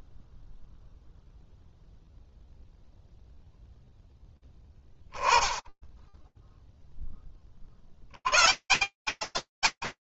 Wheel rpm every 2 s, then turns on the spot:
0, 0, 10, 10, 160.
none